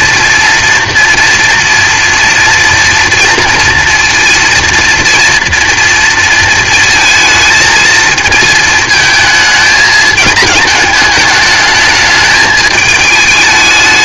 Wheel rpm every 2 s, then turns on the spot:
230, 230, 230, 230, 220, 210, 220.
none